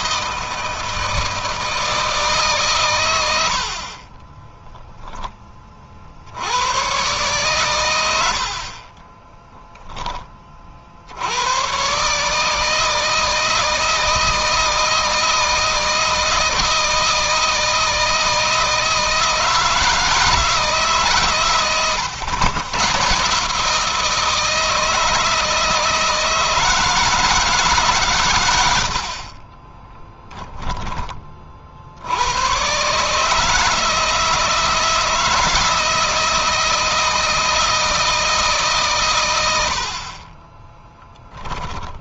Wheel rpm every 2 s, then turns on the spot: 160, 110, 0, 110, 40, 50, 160, 160, 160, 160, 150, 130, 160, 160, 80, 20, 130, 160, 160, 130, 20.
8-10 28-30 40-42